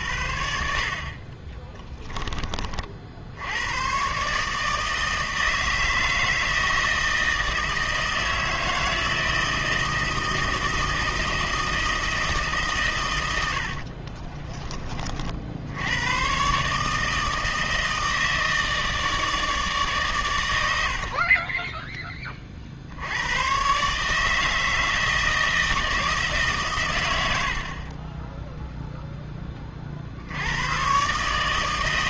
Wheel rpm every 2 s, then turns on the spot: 50, 30, 160, 160, 160, 160, 140, 30, 150, 160, 80, 60, 160, 110, 0, 110.
none